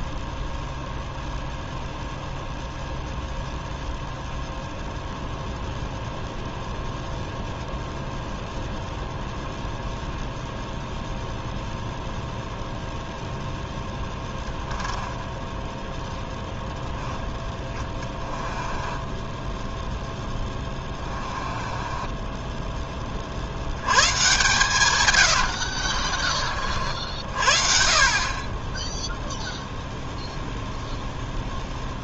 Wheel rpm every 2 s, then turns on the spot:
0, 0, 0, 0, 0, 0, 0, 10, 10, 20, 20, 10, 130, 50, 10, 0.
14-16 18-22 24-26